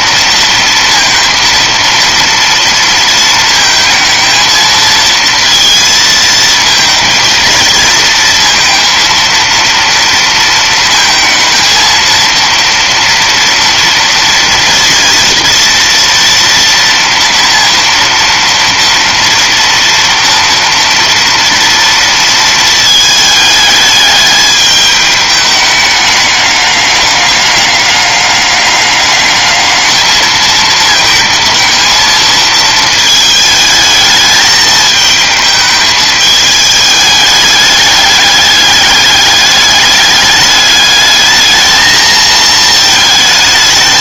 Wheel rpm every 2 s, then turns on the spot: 230, 230, 230, 230, 230, 230, 230, 230, 230, 230, 230, 220, 210, 200, 200, 220, 220, 220, 210, 210, 210, 220.
none